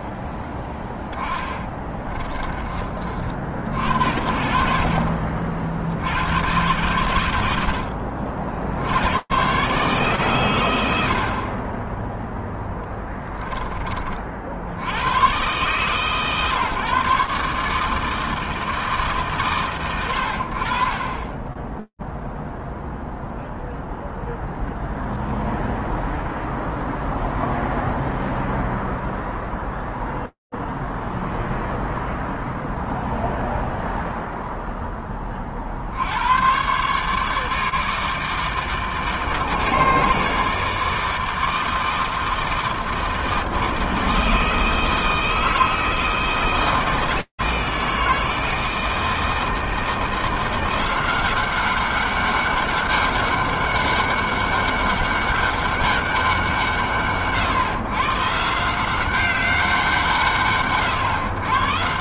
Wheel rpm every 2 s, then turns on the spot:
10, 20, 60, 100, 60, 120, 0, 60, 130, 160, 60, 0, 0, 0, 0, 0, 0, 0, 110, 150, 150, 160, 160, 160, 160, 180, 200, 200, 130, 160, 100.
none